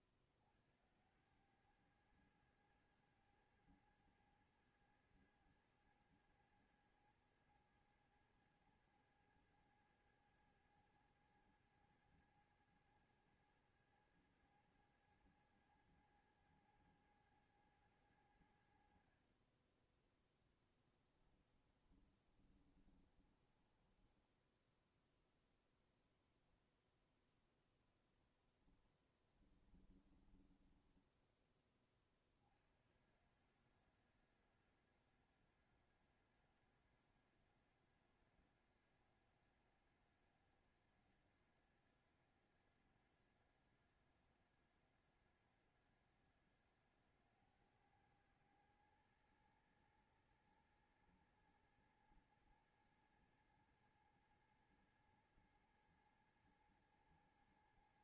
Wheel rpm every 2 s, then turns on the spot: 60, 100, 110, 110, 110, 110, 110, 110, 110, 90, 10, 10, 10, 10, 10, 20, 40, 90, 90, 90, 90, 90, 90, 90, 100, 110, 110, 110, 110.
20-32